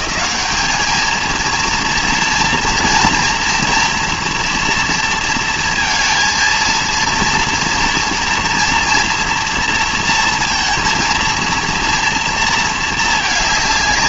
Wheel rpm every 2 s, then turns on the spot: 220, 230, 240, 230, 230, 230, 230.
none